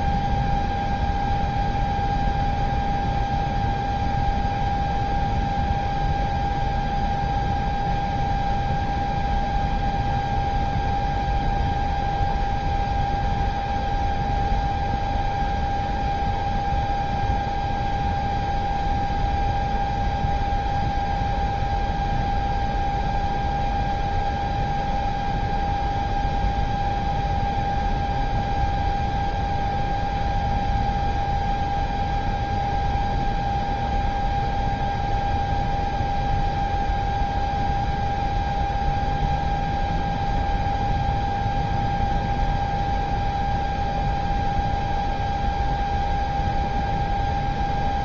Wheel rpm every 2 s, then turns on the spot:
0, 0, 0, 0, 0, 0, 0, 0, 0, 0, 0, 0, 0, 0, 0, 0, 0, 0, 0, 0, 0, 0, 0, 0.
none